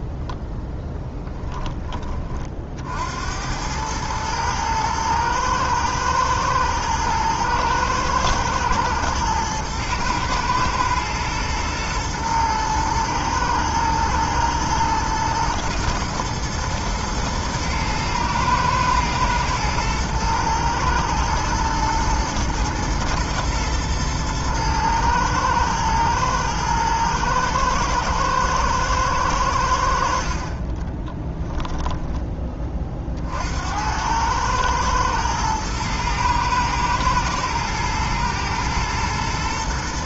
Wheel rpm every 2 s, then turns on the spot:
10, 60, 110, 120, 110, 110, 110, 110, 110, 110, 110, 110, 110, 110, 110, 20, 30, 110, 120, 120.
0-2 30-32